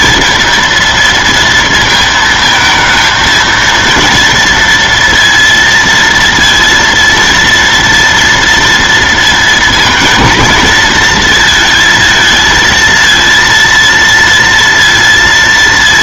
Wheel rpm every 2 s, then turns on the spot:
230, 220, 230, 230, 230, 230, 220, 230.
none